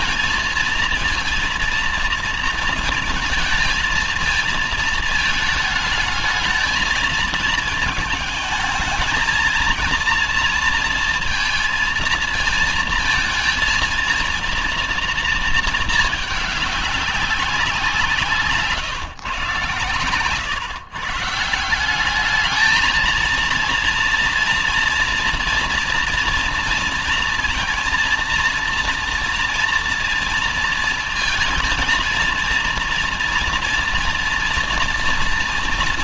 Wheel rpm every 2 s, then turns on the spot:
230, 230, 220, 220, 220, 230, 230, 230, 200, 140, 150, 220, 230, 230, 230, 230, 230, 230.
none